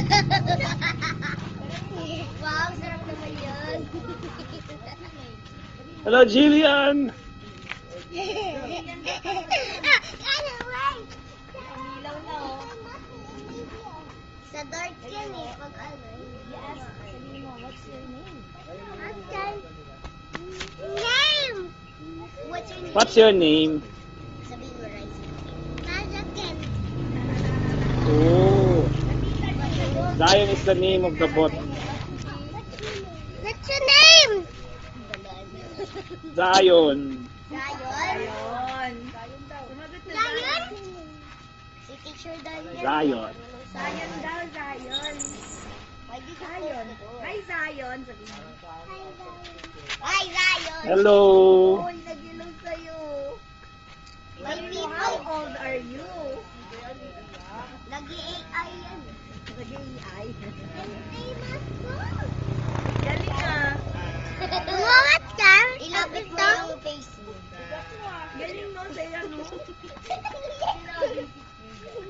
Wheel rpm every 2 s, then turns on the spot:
0, 0, 0, 0, 0, 0, 0, 0, 0, 0, 0, 0, 0, 0, 0, 0, 0, 0, 0, 0, 0, 0, 0, 0, 0, 0, 0, 0, 0, 0, 0, 0, 0, 0, 0, 0.
none